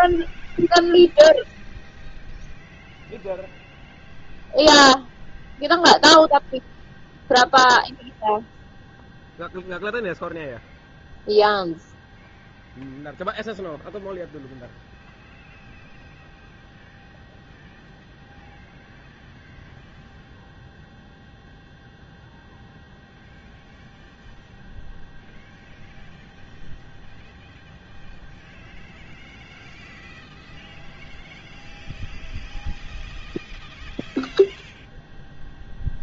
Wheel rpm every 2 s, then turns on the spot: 0, 0, 0, 0, 0, 0, 0, 0, 0, 0, 0, 0, 0, 0, 0, 0, 0, 0.
none